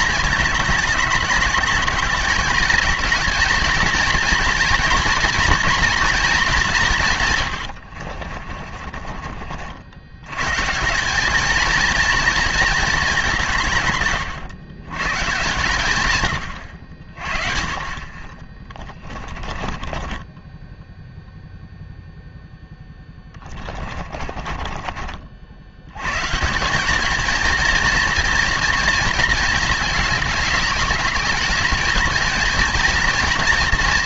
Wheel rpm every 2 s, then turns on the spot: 220, 220, 230, 200, 40, 150, 220, 120, 90, 20, 10, 10, 40, 180, 230, 210, 230.
8-10 18-22 24-26